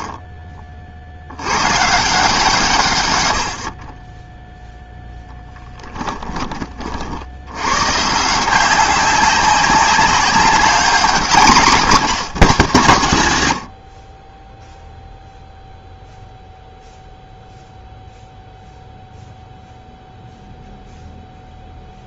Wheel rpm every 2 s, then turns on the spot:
50, 120, 0, 30, 180, 200, 180, 0, 0, 0, 0.
none